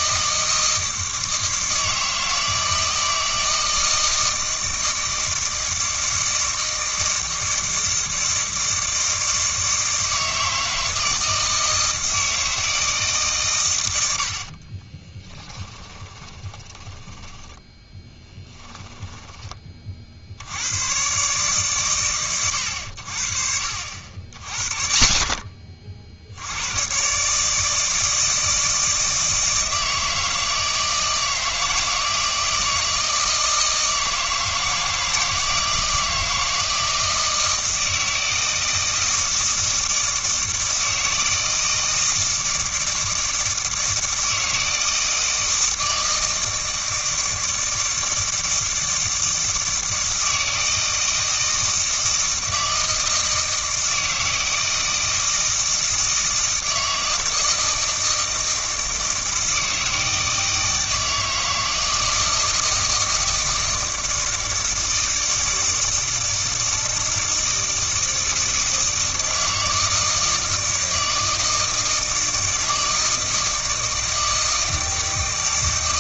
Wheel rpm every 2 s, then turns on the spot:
160, 160, 160, 160, 160, 160, 160, 30, 20, 10, 120, 80, 50, 110, 160, 160, 160, 160, 160, 160, 160, 160, 160, 160, 160, 160, 160, 160, 160, 160, 160, 160, 160, 160, 160, 160, 160, 160.
14-20